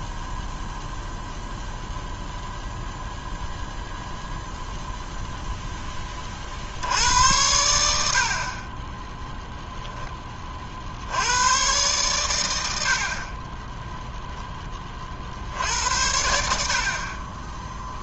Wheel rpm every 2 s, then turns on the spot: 0, 0, 0, 50, 30, 30, 100, 10, 70.
none